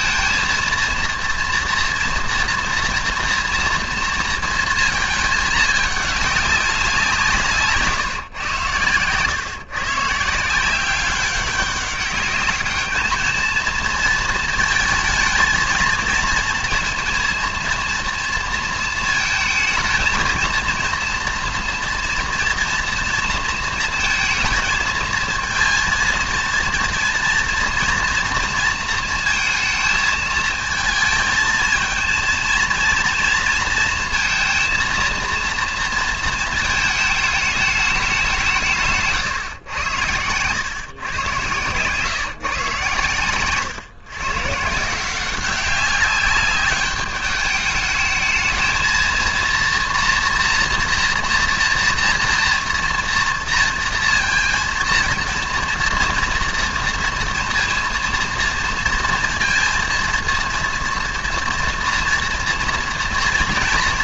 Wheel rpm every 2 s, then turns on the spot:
230, 230, 220, 200, 120, 170, 220, 220, 230, 230, 230, 230, 230, 230, 230, 220, 230, 230, 230, 160, 120, 140, 150, 200, 220, 230, 230, 230, 230, 230, 230, 230.
none